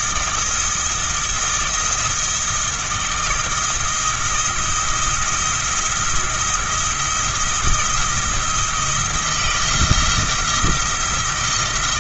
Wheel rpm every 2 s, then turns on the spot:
170, 170, 160, 170, 170, 170.
none